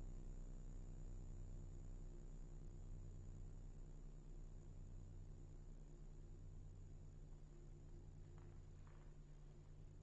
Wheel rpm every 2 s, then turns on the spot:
0, 0, 0, 0, 0.
none